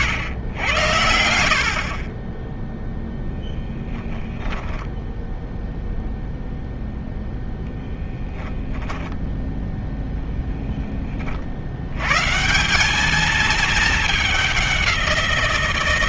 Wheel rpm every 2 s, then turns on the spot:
90, 0, 0, 0, 0, 20, 200, 180.
none